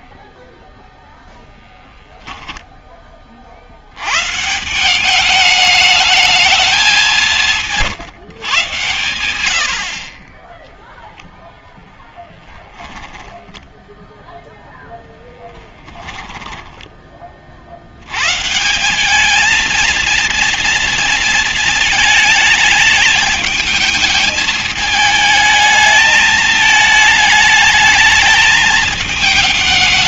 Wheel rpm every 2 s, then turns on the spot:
10, 0, 80, 210, 160, 40, 0, 0, 10, 110, 230, 220, 220, 220, 220.
16-18